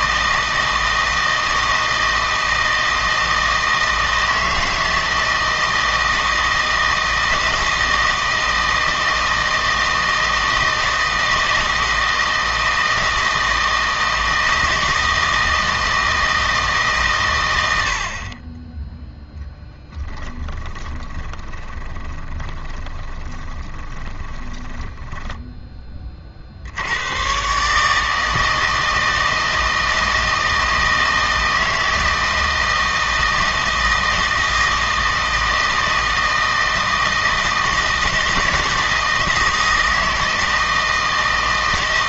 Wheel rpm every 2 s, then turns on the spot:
160, 160, 160, 160, 160, 160, 160, 160, 150, 10, 20, 20, 10, 70, 160, 160, 160, 160, 160, 160, 160.
20-26